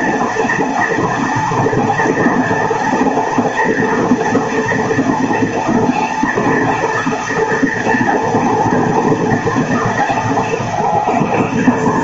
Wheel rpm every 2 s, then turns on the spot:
230, 230, 240, 240, 230, 230.
none